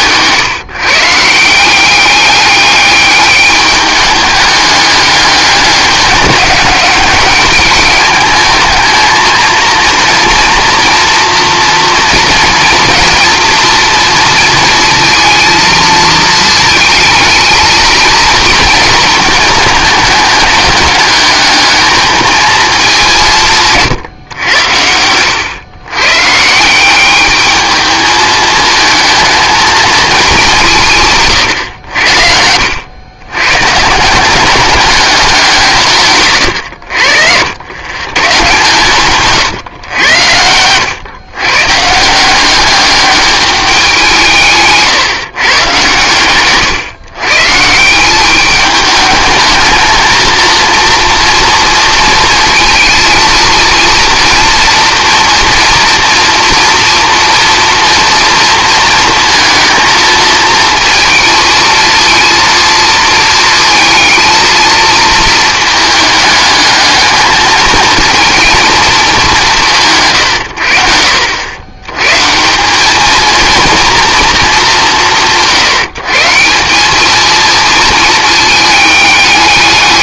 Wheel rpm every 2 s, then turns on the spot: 150, 200, 200, 200, 220, 230, 230, 230, 220, 230, 210, 220, 110, 170, 220, 180, 90, 190, 100, 130, 100, 200, 140, 120, 210, 230, 220, 230, 240, 230, 230, 230, 230, 210, 220, 80, 180, 180, 180, 220.
36-38 44-48